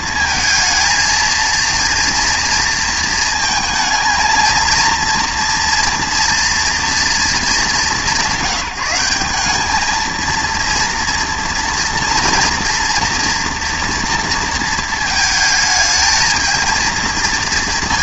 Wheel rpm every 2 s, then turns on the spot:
230, 230, 230, 230, 180, 230, 230, 220, 220.
none